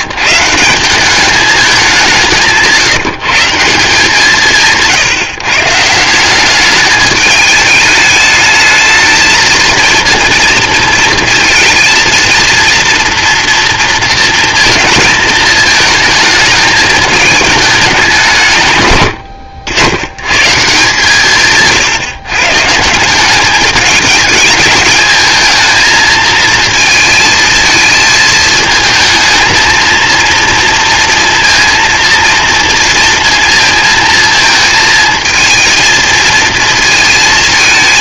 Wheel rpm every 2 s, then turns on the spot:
160, 160, 160, 200, 220, 230, 230, 230, 220, 140, 130, 140, 220, 220, 220, 230, 230, 220, 230.
none